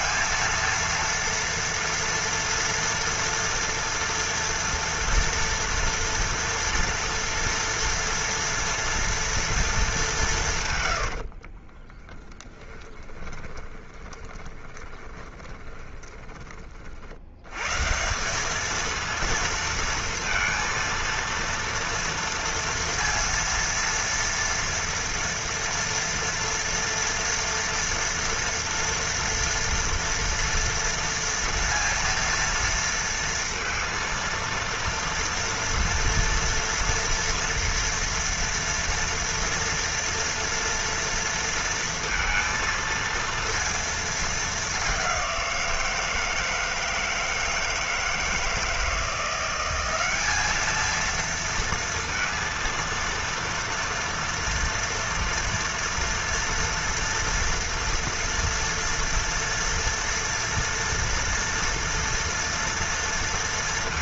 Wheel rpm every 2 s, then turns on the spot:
230, 230, 230, 230, 240, 120, 20, 20, 40, 220, 230, 230, 230, 230, 230, 230, 230, 230, 230, 240, 230, 230, 200, 160, 170, 220, 230, 230, 240, 230, 230, 230.
10-16